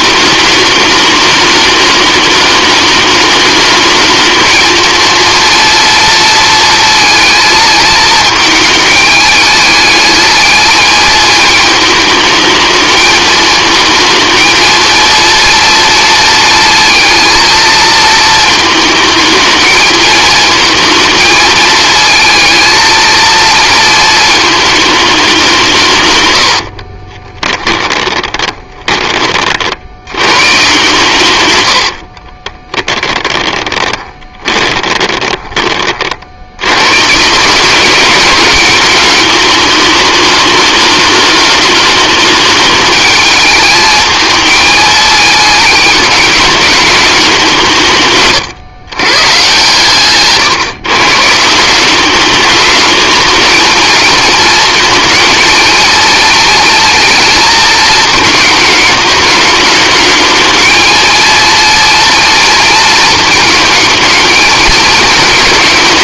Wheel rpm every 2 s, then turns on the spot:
210, 210, 230, 230, 220, 220, 220, 230, 230, 220, 220, 230, 210, 60, 30, 130, 10, 20, 120, 210, 210, 210, 210, 210, 130, 140, 210, 230, 230, 210, 220, 230, 220.
26-28 32-36